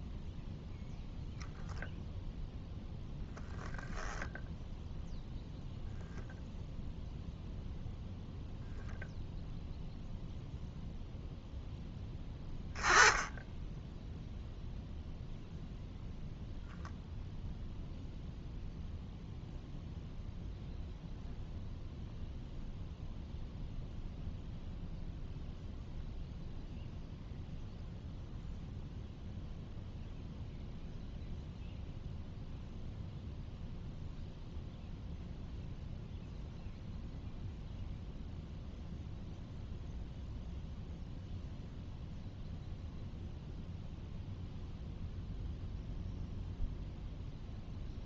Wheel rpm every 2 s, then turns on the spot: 0, 0, 0, 0, 0, 0, 20, 0, 0, 0, 0, 0, 0, 0, 0, 0, 0, 0, 0, 0, 0, 0, 0, 0.
none